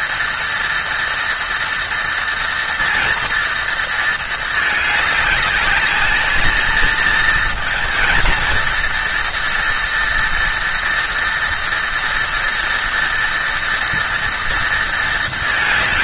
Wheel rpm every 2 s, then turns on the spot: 230, 230, 220, 220, 230, 230, 230, 230.
none